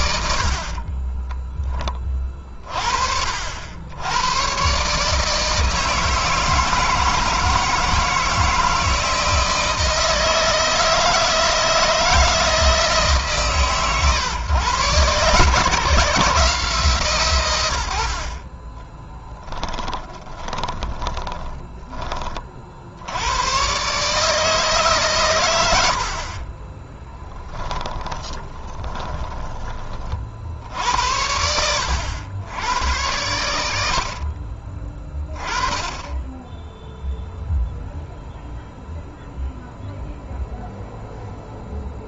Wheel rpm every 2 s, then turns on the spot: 60, 30, 120, 160, 160, 160, 160, 120, 150, 30, 20, 50, 150, 50, 10, 60, 100, 50, 10, 0, 0.
0-2 18-22 26-30